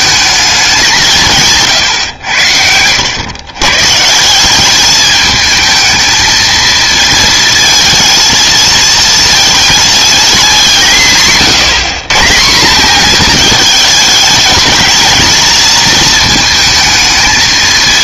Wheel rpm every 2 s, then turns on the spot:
200, 80, 190, 220, 220, 200, 190, 220, 220.
none